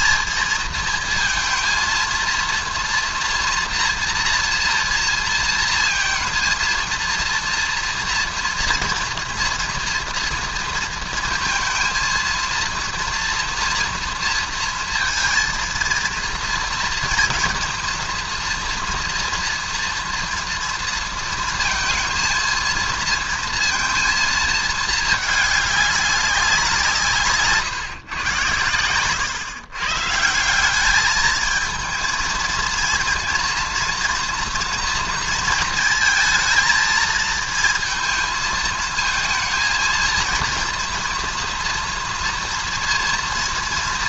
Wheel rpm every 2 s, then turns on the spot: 220, 230, 230, 230, 240, 230, 220, 230, 230, 240, 230, 230, 230, 200, 120, 140, 220, 230, 230, 220, 230, 230.
none